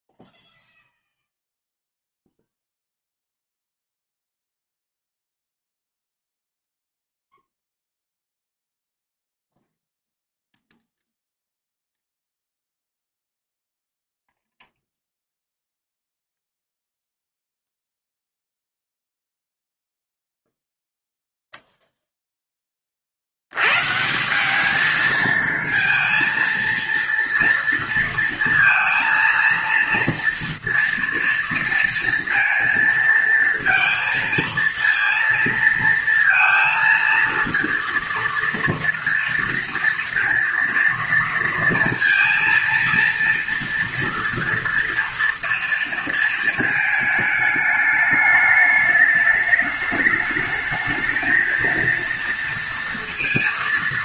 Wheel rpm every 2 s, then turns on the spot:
0, 0, 0, 0, 0, 0, 0, 0, 0, 0, 0, 10, 190, 230, 230, 230, 230, 230, 230, 230, 230, 230, 230, 220, 210, 220, 230.
none